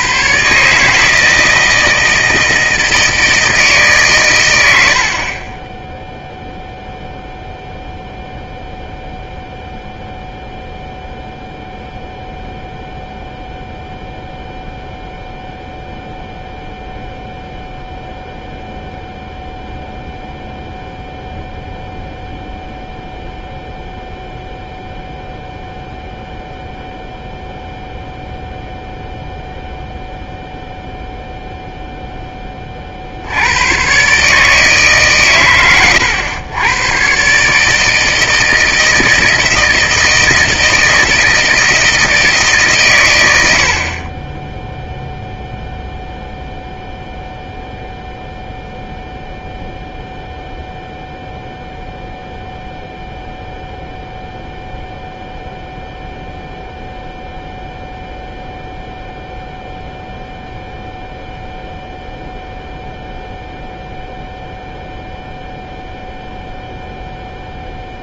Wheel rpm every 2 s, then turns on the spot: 140, 160, 80, 0, 0, 0, 0, 0, 0, 0, 0, 0, 0, 0, 0, 0, 40, 150, 110, 160, 160, 140, 10, 0, 0, 0, 0, 0, 0, 0, 0, 0, 0, 0.
none